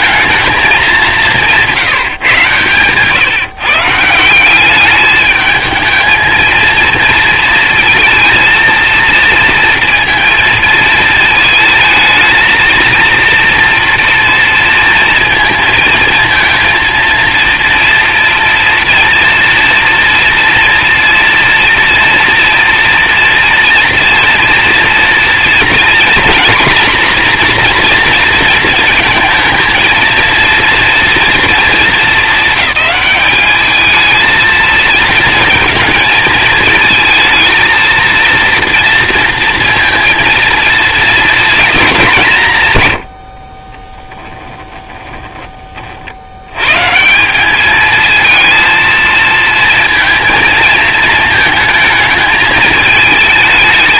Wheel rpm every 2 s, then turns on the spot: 210, 130, 200, 230, 230, 230, 220, 230, 230, 230, 230, 230, 230, 240, 230, 230, 220, 220, 220, 230, 220, 120, 20, 120, 220, 220, 220.
44-46